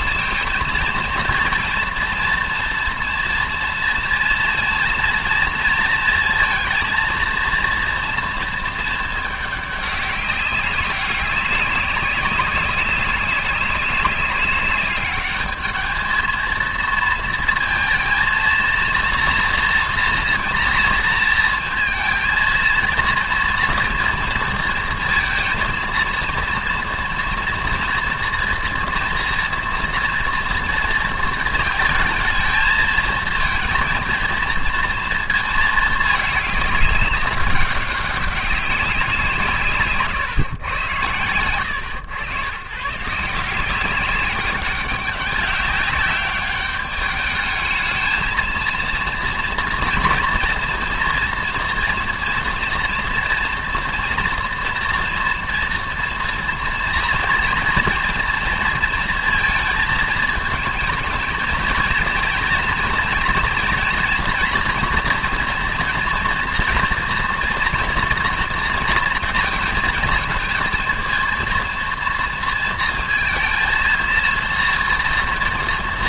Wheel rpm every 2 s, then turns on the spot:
230, 230, 230, 230, 230, 200, 190, 200, 220, 230, 230, 230, 230, 230, 240, 230, 220, 230, 210, 190, 130, 120, 200, 200, 220, 230, 230, 230, 240, 230, 220, 230, 230, 240, 230, 230, 230, 230.
none